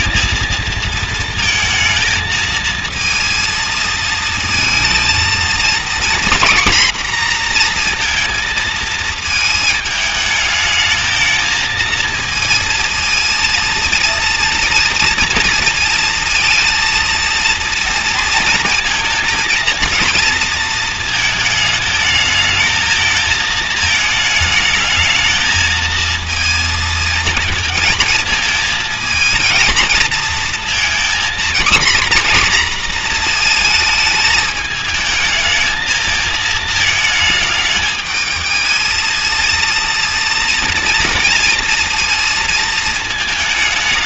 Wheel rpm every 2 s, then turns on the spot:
230, 220, 230, 240, 230, 220, 230, 230, 230, 230, 230, 220, 220, 230, 220, 230, 240, 220, 220, 220, 230, 230.
none